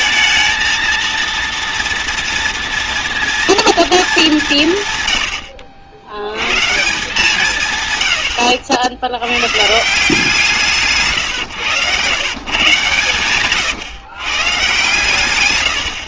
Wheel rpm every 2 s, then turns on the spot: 230, 230, 160, 130, 80, 160, 140, 140.
none